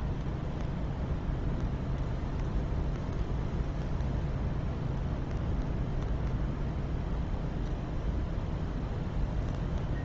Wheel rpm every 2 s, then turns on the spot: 0, 0, 0, 0, 0.
none